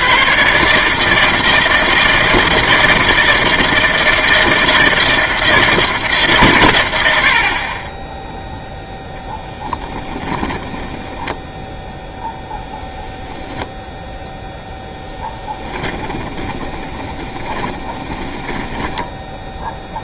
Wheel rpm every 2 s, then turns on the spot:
150, 160, 160, 100, 0, 10, 0, 10, 20, 10.
10-12 14-20